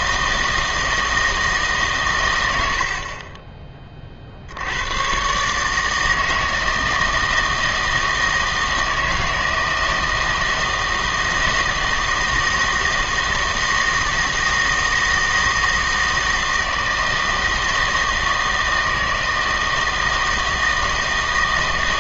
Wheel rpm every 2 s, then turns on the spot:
160, 90, 80, 160, 160, 160, 160, 160, 160, 160, 160.
none